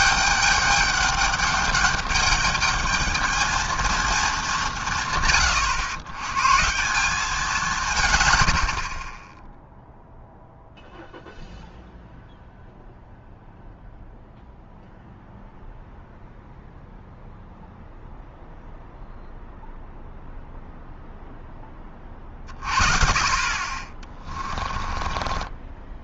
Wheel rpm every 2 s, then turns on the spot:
200, 210, 170, 170, 50, 0, 0, 0, 0, 0, 0, 50, 30.
24-26